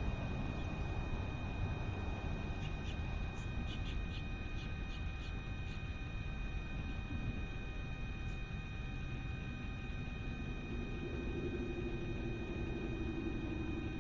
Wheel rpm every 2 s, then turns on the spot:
0, 0, 0, 0, 0, 0, 0.
none